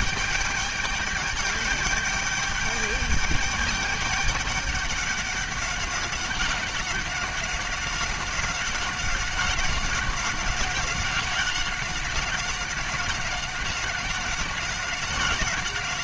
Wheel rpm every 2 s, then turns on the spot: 210, 210, 200, 190, 190, 190, 190, 190.
none